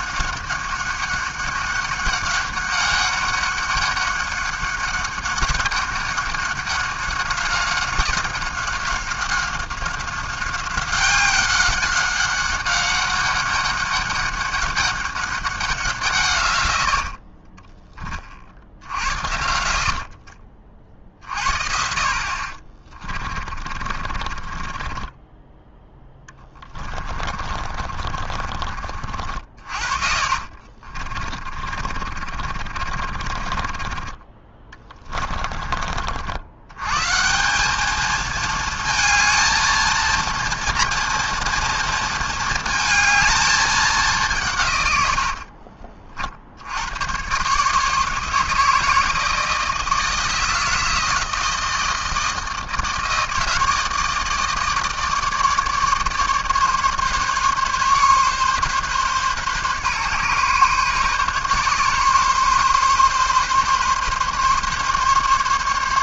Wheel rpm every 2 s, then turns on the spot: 190, 200, 200, 190, 190, 190, 200, 200, 40, 60, 40, 30, 20, 30, 50, 40, 30, 20, 100, 220, 230, 220, 130, 70, 160, 170, 160, 160, 150, 140, 140, 130, 140.
22-28 30-36